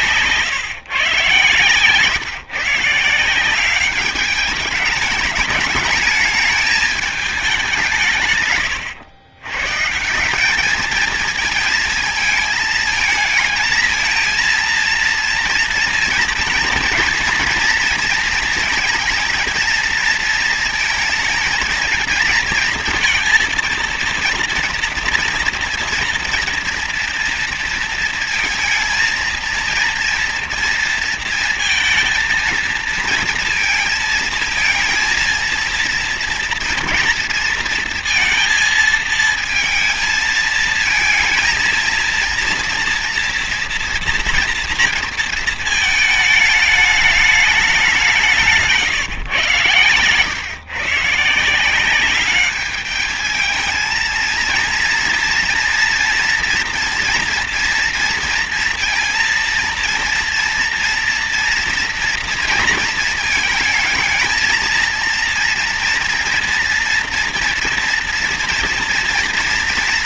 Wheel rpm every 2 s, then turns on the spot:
140, 140, 210, 220, 140, 190, 220, 230, 230, 230, 220, 230, 230, 230, 230, 230, 230, 220, 230, 230, 230, 230, 230, 210, 170, 130, 200, 230, 230, 230, 230, 230, 220, 230, 230.
none